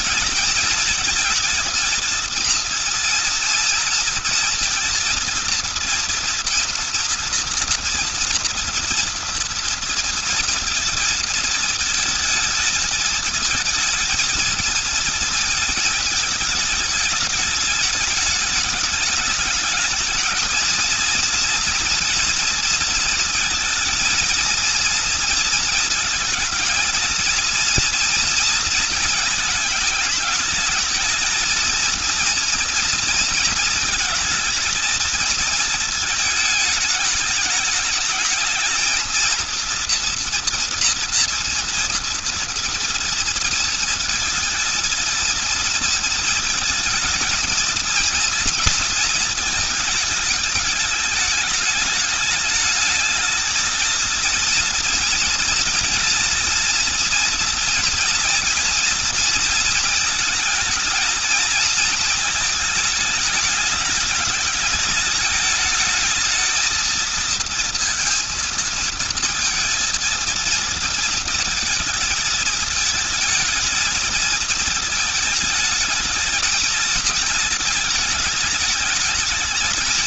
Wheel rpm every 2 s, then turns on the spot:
220, 230, 230, 230, 240, 230, 230, 230, 220, 210, 220, 240, 230, 220, 230, 210, 230, 220, 220, 220, 240, 230, 220, 220, 230, 210, 210, 230, 240, 230, 220, 220, 210, 220, 230, 230, 220, 230, 230, 220.
none